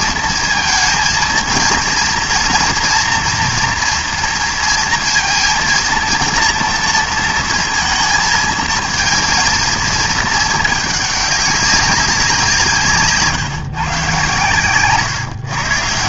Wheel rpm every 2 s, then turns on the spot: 230, 230, 230, 230, 220, 210, 160, 130.
none